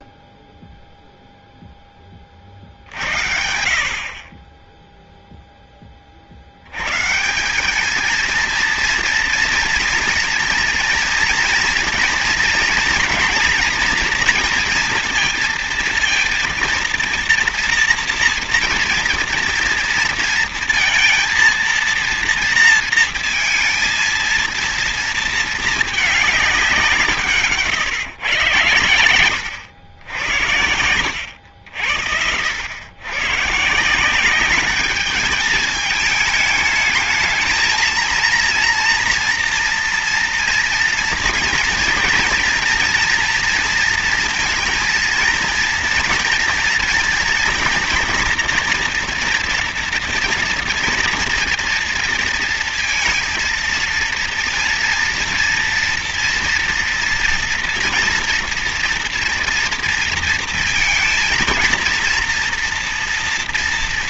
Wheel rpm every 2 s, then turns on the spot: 0, 30, 30, 60, 230, 240, 240, 240, 230, 230, 230, 230, 230, 200, 110, 80, 80, 190, 210, 230, 230, 230, 230, 230, 230, 230, 230, 230, 230, 230, 230, 230.
none